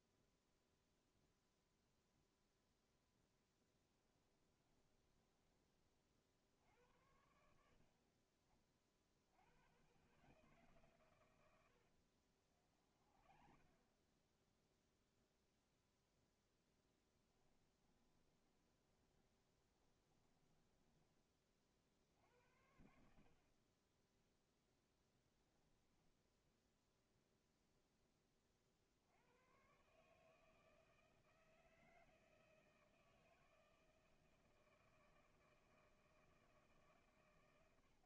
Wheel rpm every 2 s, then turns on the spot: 0, 0, 20, 70, 20, 130, 40, 0, 10, 20, 20, 70, 0, 0, 50, 160, 160, 160, 160.
4-6 12-14 16-22